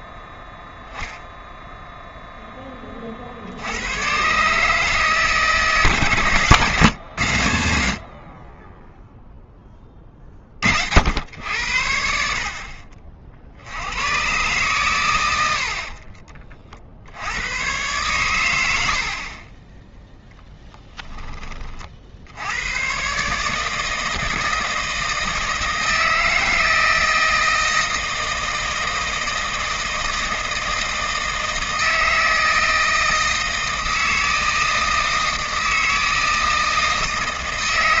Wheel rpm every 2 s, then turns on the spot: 0, 50, 150, 120, 10, 80, 70, 80, 110, 20, 40, 150, 160, 160, 160, 160, 160, 160, 160.
none